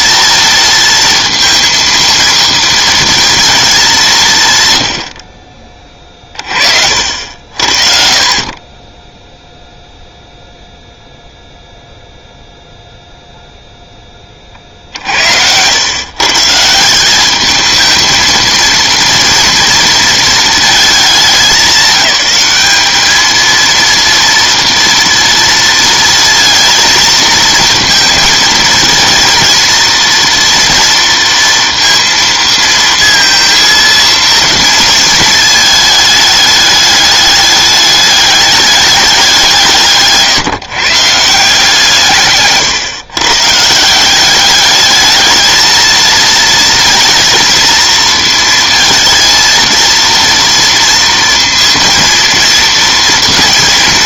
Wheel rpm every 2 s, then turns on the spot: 230, 230, 110, 50, 30, 0, 0, 40, 170, 230, 220, 210, 230, 230, 230, 230, 230, 230, 210, 210, 150, 130, 210, 230, 230, 230, 230.
none